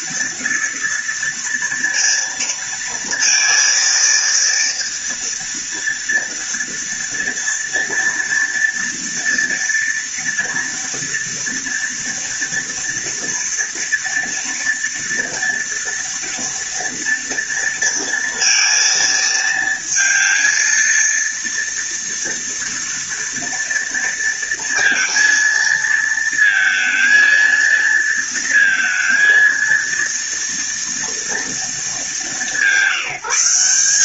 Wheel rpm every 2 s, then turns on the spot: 230, 230, 230, 240, 230, 230, 230, 230, 230, 230, 230, 230, 230, 230, 230, 230, 190.
none